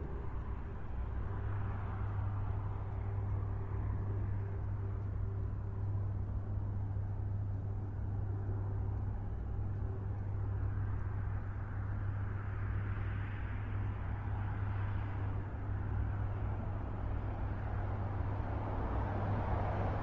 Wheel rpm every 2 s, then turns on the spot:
0, 0, 0, 0, 0, 0, 0, 0, 0, 0.
none